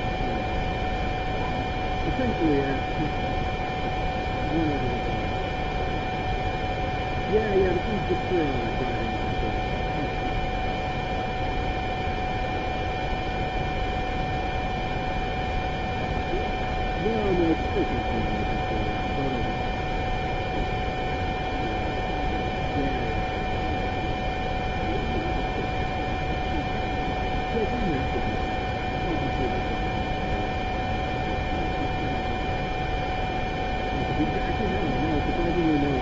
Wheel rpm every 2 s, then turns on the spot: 0, 0, 0, 0, 0, 0, 0, 0, 0, 0, 0, 0, 0, 0, 0, 0, 0, 0.
none